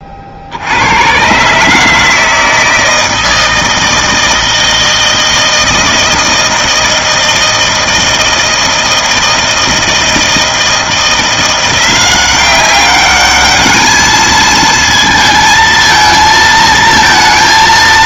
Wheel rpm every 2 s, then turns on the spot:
90, 160, 160, 160, 160, 160, 190, 220, 230.
none